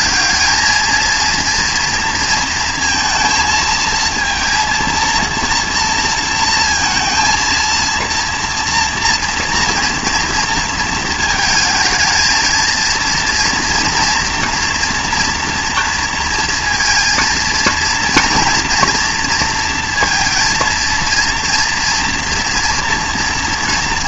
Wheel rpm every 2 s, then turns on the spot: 220, 230, 230, 230, 230, 230, 220, 230, 230, 240, 230, 230.
none